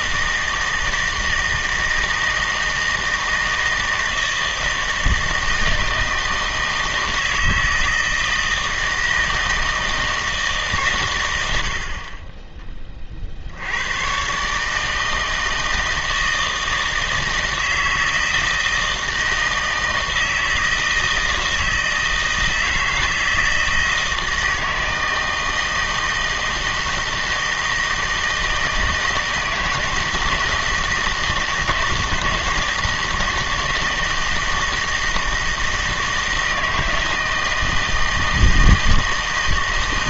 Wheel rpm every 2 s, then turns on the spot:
160, 160, 160, 160, 160, 140, 20, 150, 160, 160, 160, 160, 160, 160, 160, 160, 160, 160, 160, 160.
none